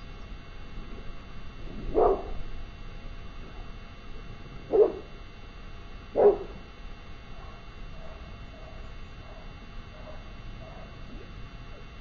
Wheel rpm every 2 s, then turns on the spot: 0, 0, 0, 0, 0, 0.
none